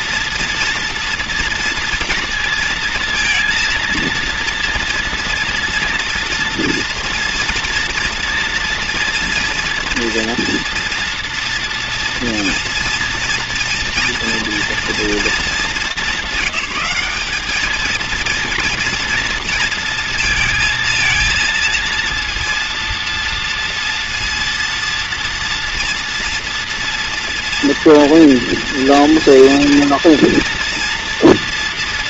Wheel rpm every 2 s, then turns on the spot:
240, 230, 230, 230, 230, 240, 230, 230, 200, 230, 230, 230, 230, 240, 240, 230.
none